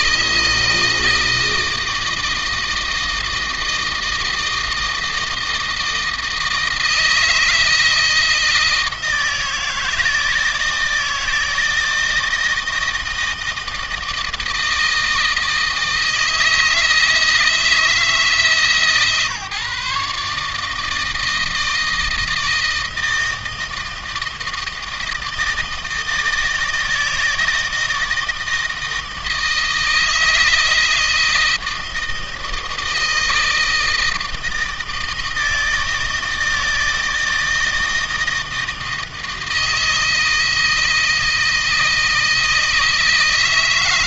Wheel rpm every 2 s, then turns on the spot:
160, 160, 160, 160, 170, 160, 160, 160, 160, 150, 160, 160, 160, 160, 160, 160, 160, 160, 160, 160, 160, 160.
none